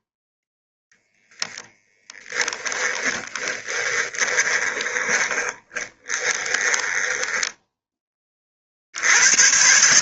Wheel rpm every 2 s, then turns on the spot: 10, 10, 20, 20, 70.
2-8